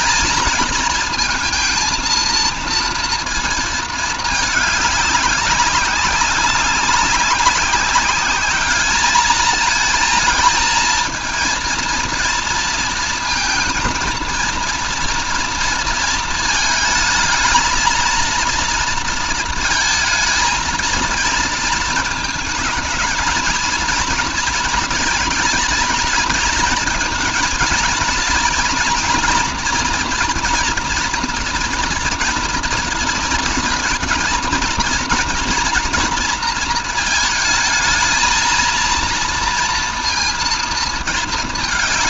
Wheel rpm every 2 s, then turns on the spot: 220, 230, 210, 190, 210, 230, 230, 230, 220, 230, 230, 220, 220, 230, 230, 230, 230, 230, 230, 230, 220.
none